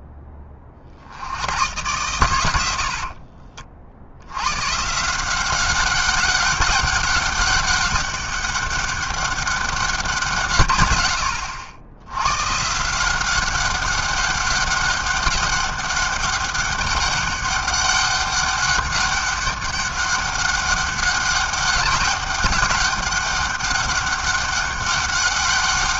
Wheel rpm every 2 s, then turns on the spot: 70, 50, 180, 200, 200, 90, 180, 200, 200, 200, 200, 200, 200.
2-4